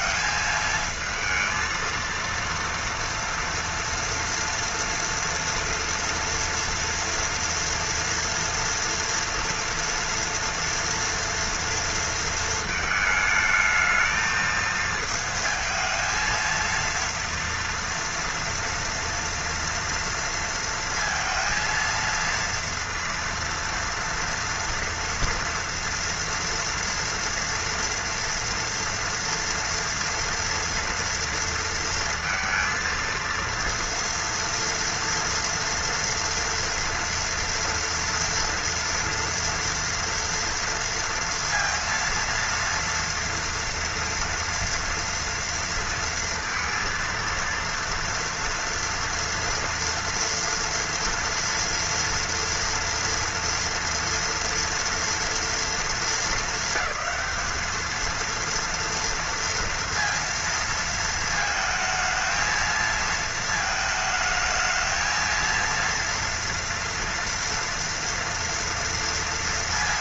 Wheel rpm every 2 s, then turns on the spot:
220, 230, 230, 240, 230, 230, 220, 220, 230, 230, 230, 230, 240, 230, 230, 230, 230, 230, 230, 230, 230, 230, 230, 230, 240, 230, 230, 230, 200, 230, 220, 230, 220, 230, 230.
none